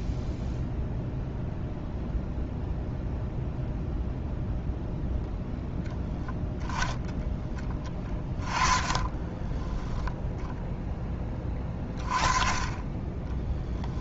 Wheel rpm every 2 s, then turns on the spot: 0, 0, 0, 20, 20, 10, 20.
8-10